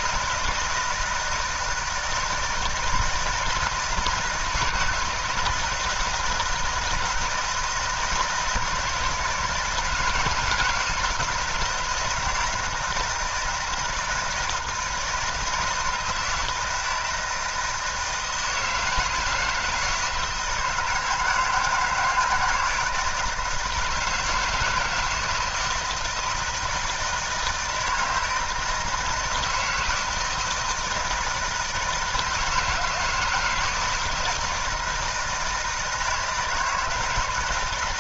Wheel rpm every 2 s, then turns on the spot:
160, 160, 160, 160, 160, 160, 160, 160, 160, 160, 160, 170, 160, 160, 160, 160, 160, 160, 160.
none